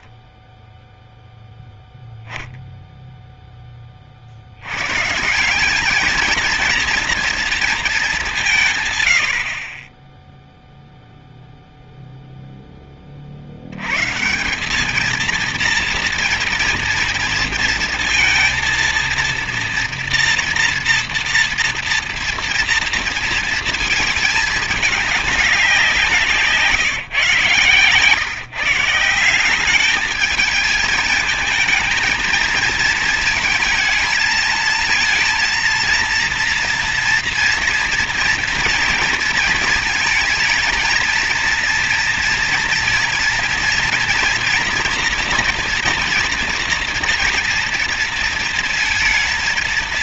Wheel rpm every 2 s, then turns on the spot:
0, 40, 220, 210, 30, 0, 100, 230, 230, 230, 230, 220, 180, 130, 190, 220, 220, 230, 230, 220, 230, 230, 230, 230, 230.
none